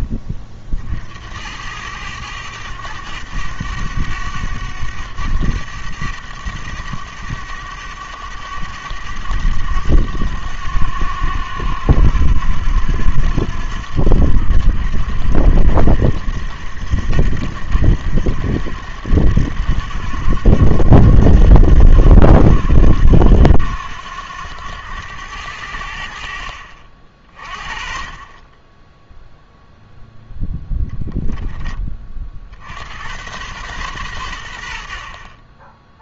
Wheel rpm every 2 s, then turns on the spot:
50, 100, 100, 100, 100, 90, 90, 90, 90, 90, 90, 90, 100, 50, 20, 10, 90, 70.
none